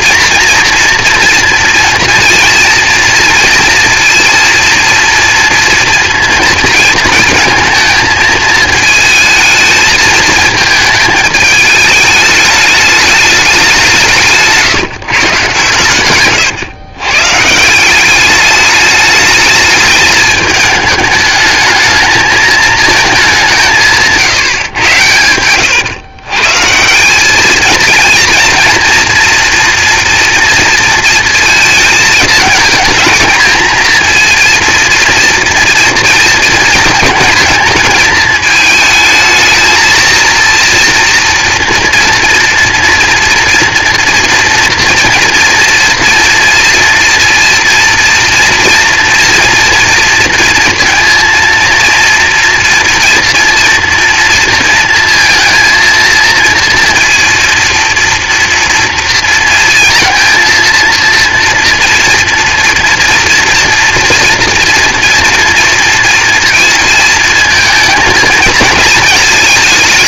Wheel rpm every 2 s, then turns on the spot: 230, 230, 230, 230, 220, 220, 210, 160, 130, 210, 220, 220, 150, 140, 230, 230, 220, 230, 230, 220, 230, 240, 230, 230, 230, 230, 240, 230, 230, 230, 230, 230, 240, 230, 220.
24-26